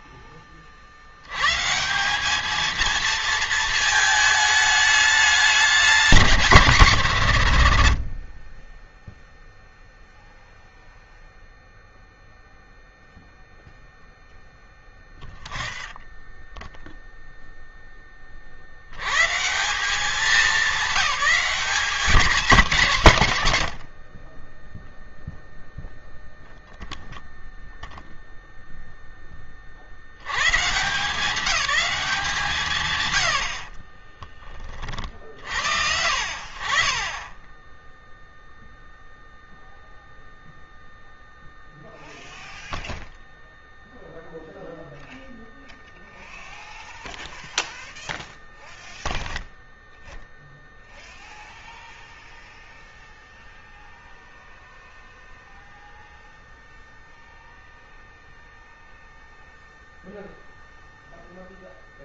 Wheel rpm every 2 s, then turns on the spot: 40, 230, 210, 140, 0, 0, 0, 0, 0, 90, 200, 140, 0, 0, 0, 160, 100, 40, 50, 0, 0, 0, 0, 0, 0, 0, 0, 0, 0, 0, 0.
22-24 32-34